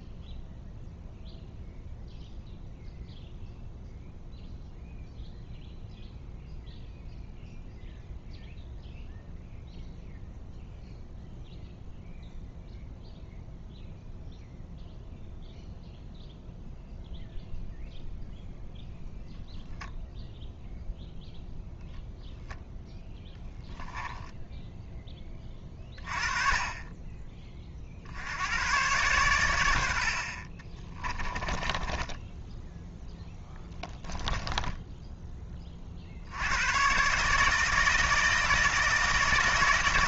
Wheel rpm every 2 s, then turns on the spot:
0, 0, 0, 0, 0, 0, 0, 0, 0, 0, 0, 0, 0, 30, 100, 30, 10, 20, 100, 160.
30-32 34-36